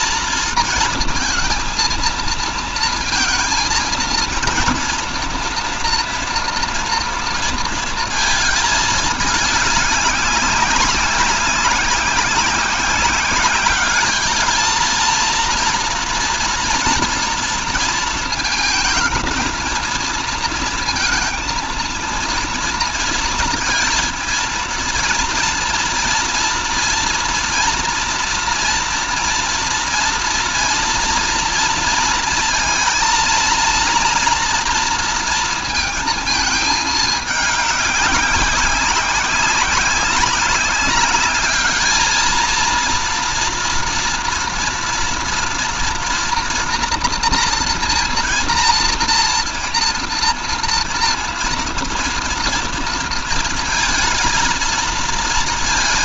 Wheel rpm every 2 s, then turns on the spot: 230, 220, 230, 230, 210, 190, 190, 220, 230, 220, 230, 230, 230, 230, 230, 230, 230, 230, 210, 190, 190, 230, 230, 240, 230, 230, 230, 220.
none